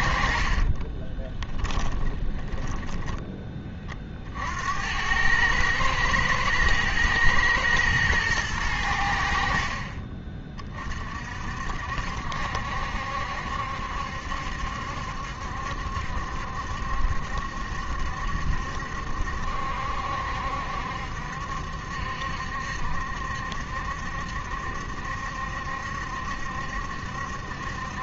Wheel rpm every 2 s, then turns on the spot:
30, 10, 80, 110, 90, 40, 70, 70, 70, 70, 70, 70, 70, 70.
0-4